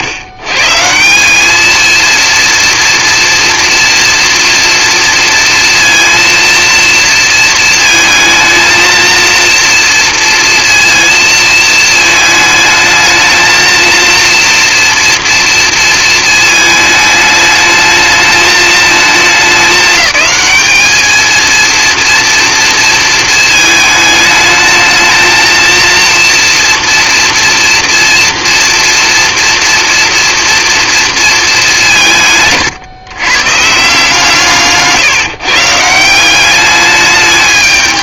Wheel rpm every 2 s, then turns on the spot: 150, 240, 230, 230, 220, 230, 220, 230, 220, 220, 220, 230, 220, 230, 230, 230, 150, 150, 210.
32-34